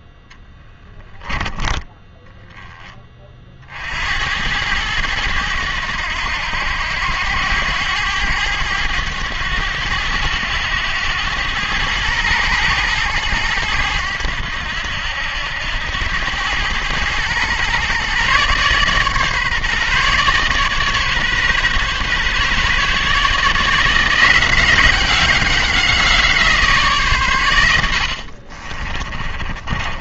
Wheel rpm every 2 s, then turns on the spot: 10, 20, 100, 80, 100, 100, 110, 80, 100, 140, 140, 140, 180, 160, 40.
28-30